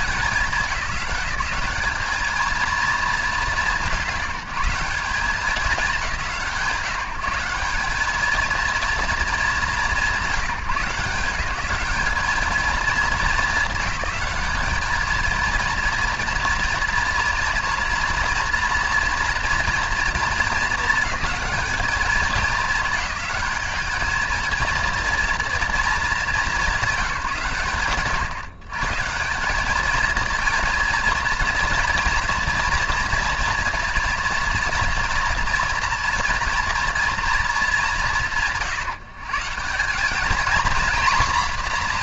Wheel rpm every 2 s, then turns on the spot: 200, 210, 190, 180, 220, 160, 210, 220, 230, 240, 220, 210, 240, 170, 180, 230, 240, 230, 230, 150, 240.
none